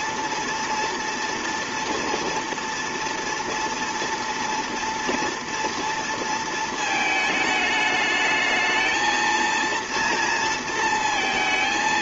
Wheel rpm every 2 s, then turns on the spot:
230, 230, 230, 220, 220, 230.
none